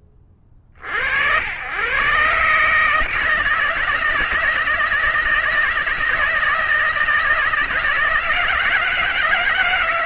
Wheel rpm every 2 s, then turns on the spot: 70, 150, 170, 160, 160.
none